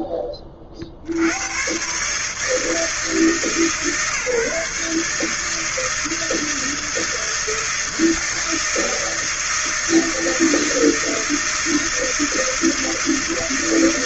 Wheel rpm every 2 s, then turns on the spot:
20, 150, 150, 160, 160, 160, 160.
none